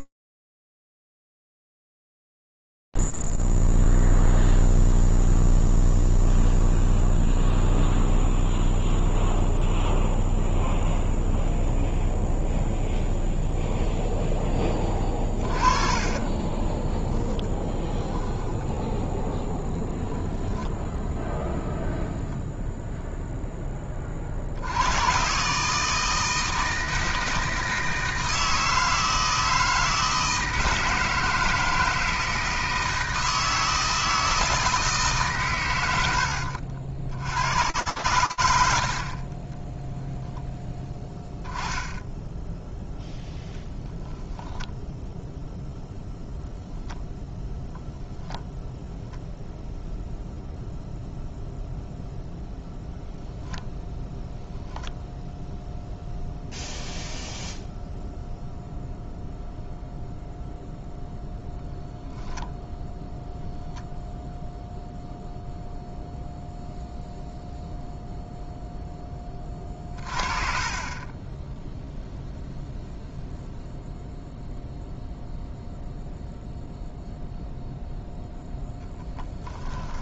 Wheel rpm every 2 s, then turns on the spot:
0, 0, 0, 0, 0, 0, 0, 10, 20, 0, 0, 0, 110, 160, 160, 160, 160, 150, 100, 30, 10, 10, 10, 0, 0, 0, 0, 0, 0, 0, 0, 0, 0, 0, 30, 10, 0, 0, 0, 10.
16-18 38-42 78-80